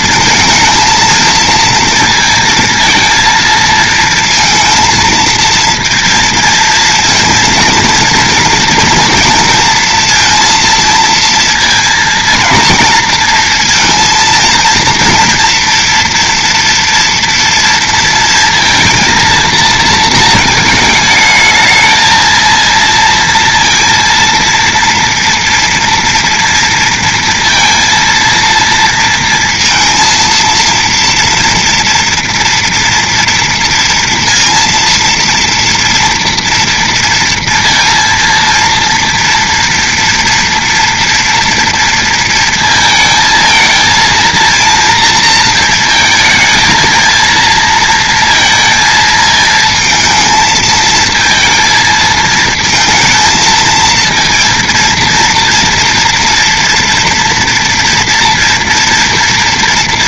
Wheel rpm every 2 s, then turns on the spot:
220, 220, 230, 230, 230, 230, 230, 230, 230, 230, 220, 230, 230, 230, 230, 230, 230, 230, 230, 230, 240, 230, 230, 220, 230, 220, 230, 230, 230, 230.
none